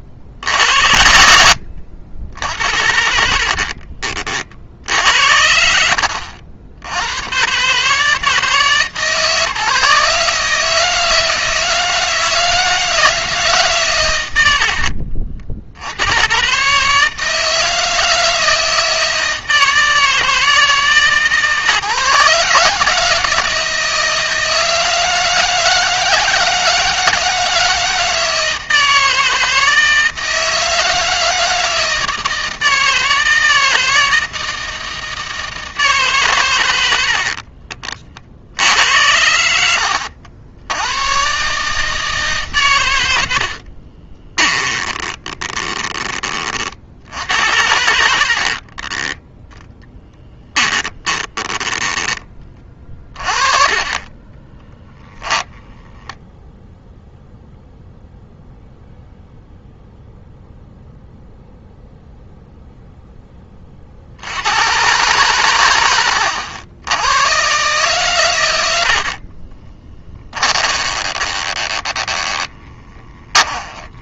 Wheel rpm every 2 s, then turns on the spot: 70, 70, 60, 90, 150, 160, 160, 60, 150, 160, 150, 150, 160, 160, 160, 160, 160, 160, 80, 70, 100, 100, 20, 60, 20, 20, 30, 10, 0, 0, 0, 0, 120, 100, 80, 30, 20.
2-4 44-46 48-52 54-56 68-74